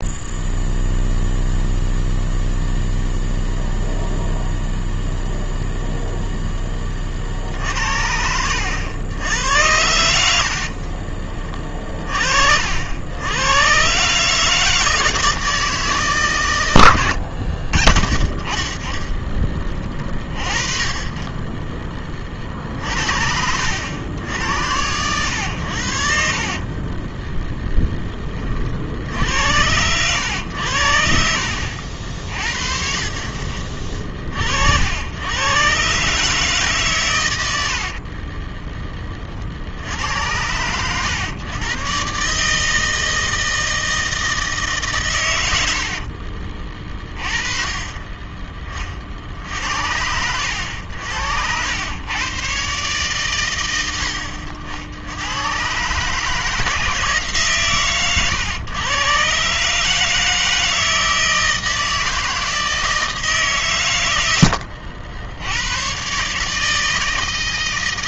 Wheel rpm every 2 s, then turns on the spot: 0, 0, 0, 10, 80, 60, 60, 150, 120, 30, 30, 50, 90, 50, 30, 90, 50, 60, 140, 20, 100, 150, 150, 30, 20, 90, 130, 60, 160, 120, 160, 160, 90, 150.
10-12 26-28 64-66